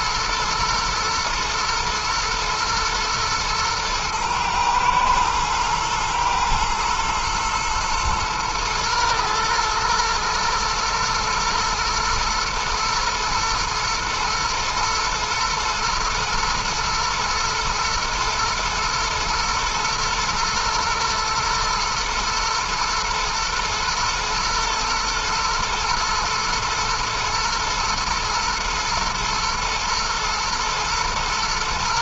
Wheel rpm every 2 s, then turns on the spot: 120, 110, 110, 120, 110, 110, 110, 120, 120, 120, 120, 110, 110, 110, 110, 110.
none